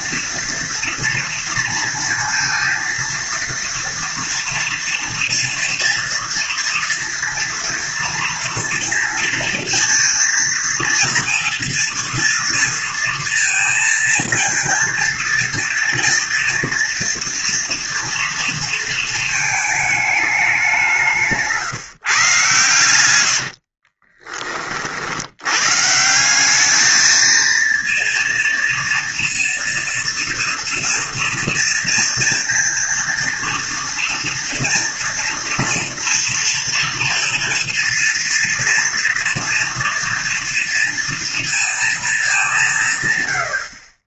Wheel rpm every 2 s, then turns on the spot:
230, 230, 230, 240, 230, 230, 230, 230, 230, 230, 190, 120, 40, 210, 230, 230, 230, 230, 230, 230, 230, 180.
none